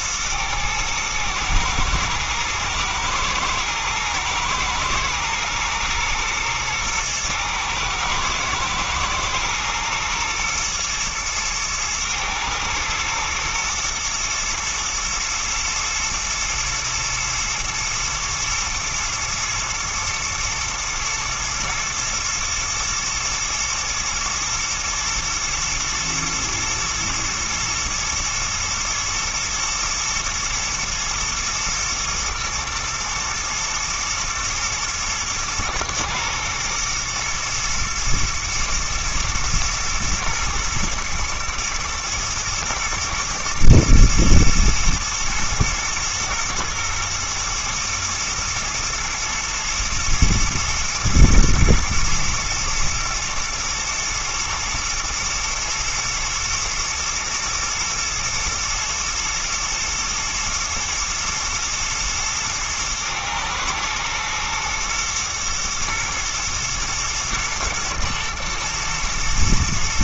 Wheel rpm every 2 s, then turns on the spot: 110, 110, 110, 120, 110, 120, 110, 110, 120, 120, 110, 110, 110, 110, 120, 110, 110, 110, 120, 110, 110, 110, 120, 120, 110, 120, 110, 110, 120, 110, 110, 110, 120, 110, 120.
none